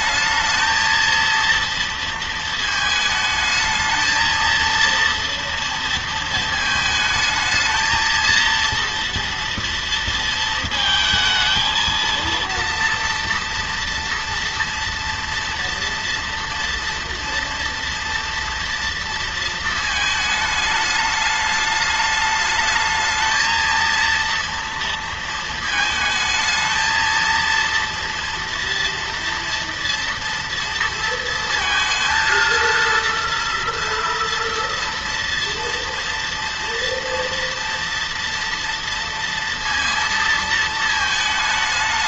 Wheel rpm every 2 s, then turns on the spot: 220, 220, 230, 220, 230, 230, 230, 230, 230, 230, 220, 210, 230, 220, 230, 230, 230, 230, 230, 230, 230.
none